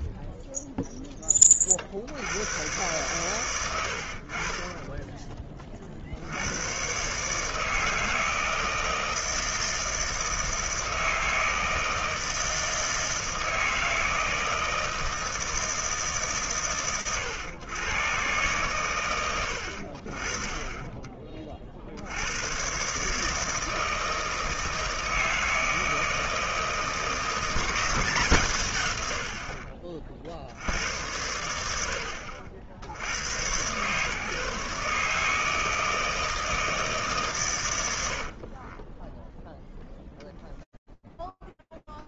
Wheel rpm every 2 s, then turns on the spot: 0, 100, 40, 110, 160, 160, 160, 160, 110, 110, 30, 150, 160, 160, 60, 80, 120, 160, 120, 0, 0.
36-38